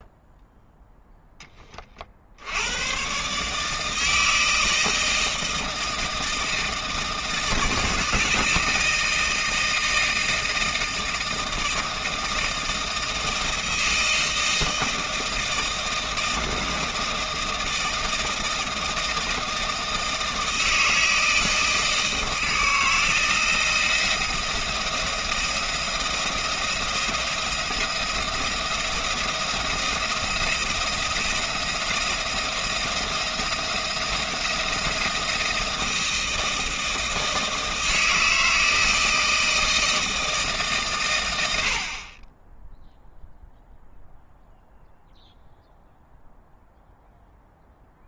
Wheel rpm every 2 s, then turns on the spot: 0, 90, 160, 160, 160, 160, 160, 160, 160, 160, 160, 160, 170, 170, 170, 170, 170, 170, 160, 160, 150, 10, 0, 0.
none